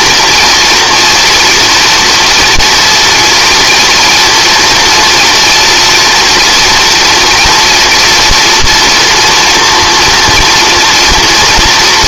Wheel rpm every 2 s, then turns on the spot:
240, 230, 230, 230, 230, 230.
none